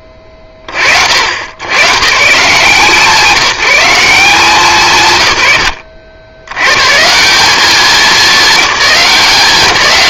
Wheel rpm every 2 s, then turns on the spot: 40, 150, 160, 110, 200.
none